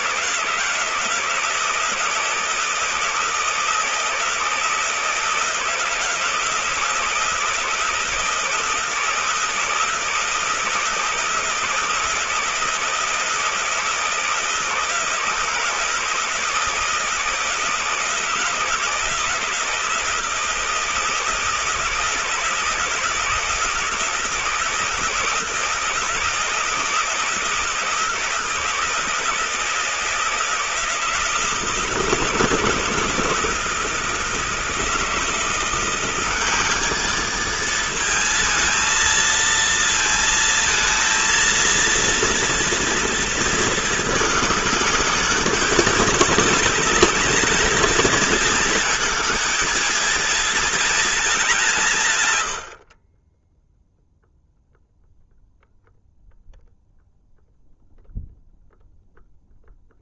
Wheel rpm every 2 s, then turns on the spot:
160, 160, 160, 170, 160, 160, 160, 160, 160, 160, 160, 160, 160, 160, 160, 160, 160, 160, 190, 230, 230, 230, 210, 210, 220, 220, 80, 0, 0, 0.
none